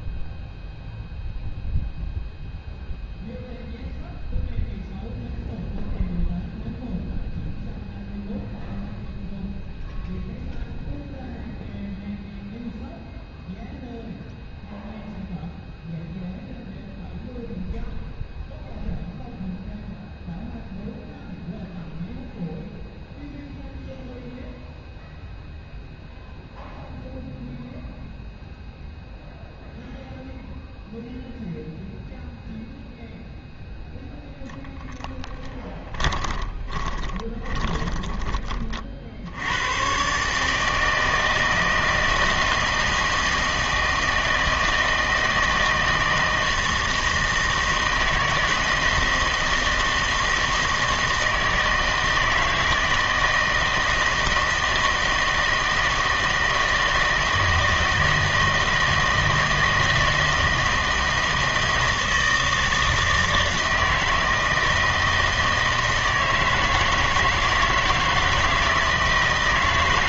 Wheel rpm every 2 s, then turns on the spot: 0, 0, 0, 0, 0, 0, 0, 0, 0, 0, 0, 0, 0, 0, 0, 0, 0, 0, 20, 30, 150, 160, 160, 160, 160, 160, 160, 160, 160, 160, 160, 160, 160, 160, 160.
36-38